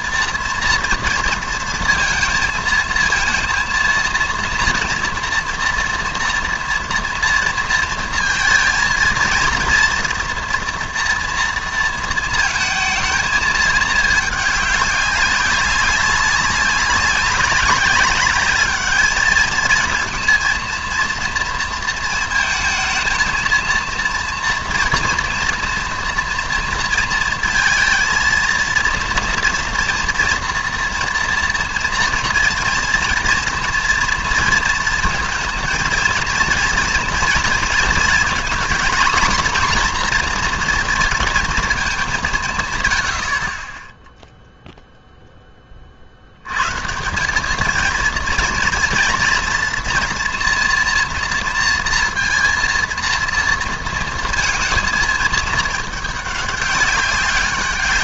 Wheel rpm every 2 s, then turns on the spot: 240, 230, 240, 240, 230, 230, 220, 210, 200, 210, 230, 230, 230, 230, 230, 230, 230, 230, 230, 240, 230, 150, 0, 120, 230, 240, 230, 230, 200.
none